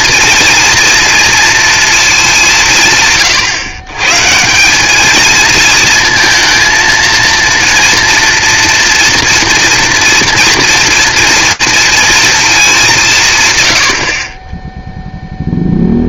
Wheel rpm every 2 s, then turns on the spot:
230, 170, 180, 230, 230, 240, 210, 10.
none